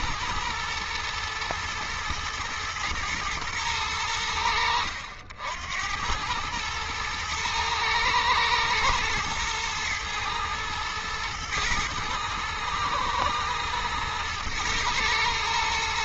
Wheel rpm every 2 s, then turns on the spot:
120, 110, 80, 110, 110, 120, 110, 110.
none